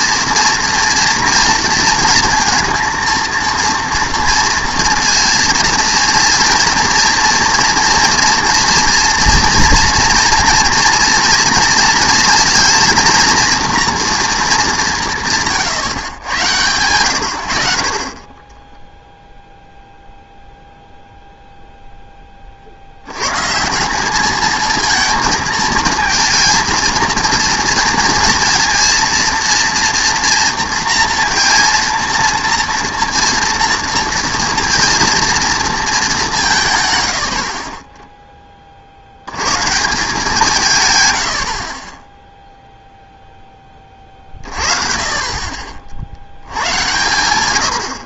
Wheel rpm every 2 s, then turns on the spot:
230, 230, 230, 230, 230, 230, 220, 220, 110, 10, 0, 50, 220, 230, 230, 230, 230, 230, 150, 30, 160, 0, 30, 110.
18-20